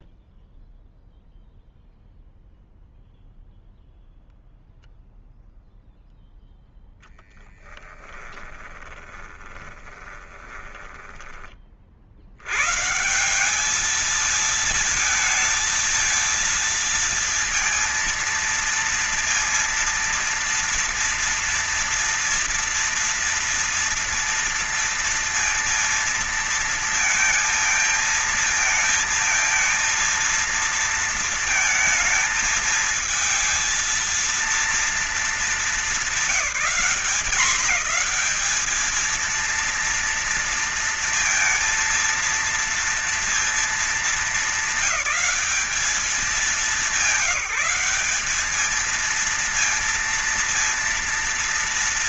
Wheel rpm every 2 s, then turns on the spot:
0, 0, 0, 0, 20, 10, 90, 220, 230, 230, 230, 230, 230, 230, 220, 230, 220, 230, 190, 200, 230, 230, 220, 210, 220, 230.
8-12